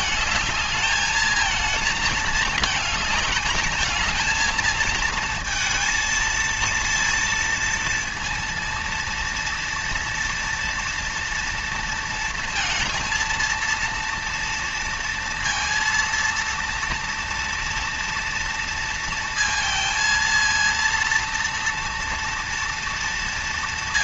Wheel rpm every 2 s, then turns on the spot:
220, 220, 220, 230, 230, 230, 230, 230, 230, 230, 230, 230.
none